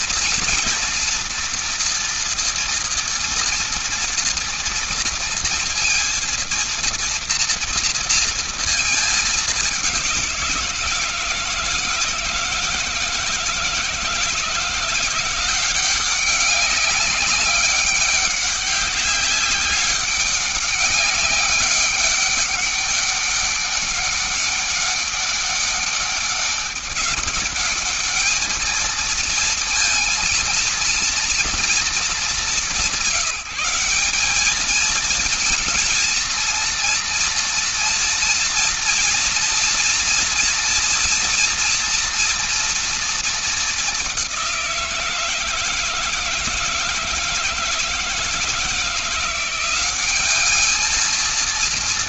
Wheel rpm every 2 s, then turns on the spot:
240, 230, 230, 230, 230, 180, 160, 170, 190, 200, 200, 200, 200, 200, 220, 230, 200, 200, 230, 230, 230, 230, 190, 160, 170, 210.
none